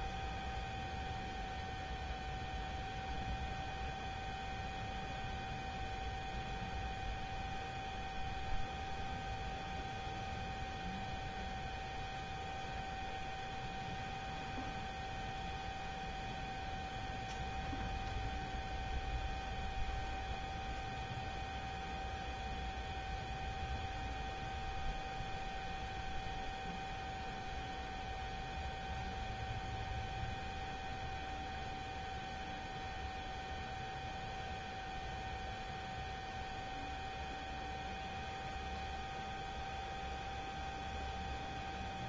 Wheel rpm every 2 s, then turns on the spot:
0, 0, 0, 0, 0, 0, 0, 0, 0, 0, 0, 0, 0, 0, 0, 0, 0, 0, 0, 0, 0.
none